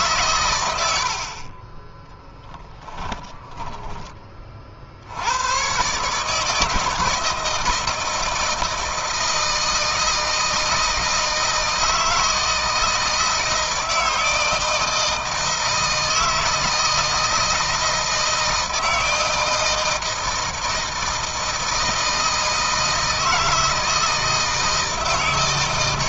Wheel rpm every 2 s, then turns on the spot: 100, 10, 50, 160, 160, 160, 160, 160, 160, 160, 160, 160, 160.
2-4